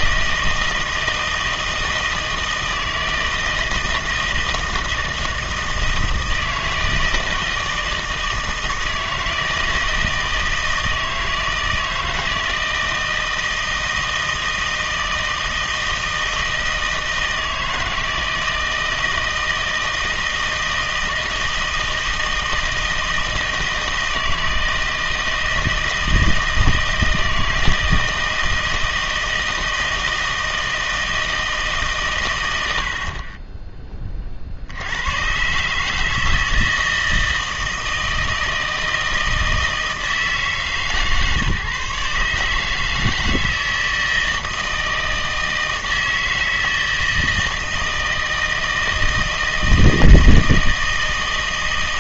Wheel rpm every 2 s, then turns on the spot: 160, 160, 160, 160, 160, 160, 160, 160, 160, 160, 160, 160, 160, 160, 160, 160, 80, 70, 160, 160, 150, 150, 160, 160, 160, 160.
none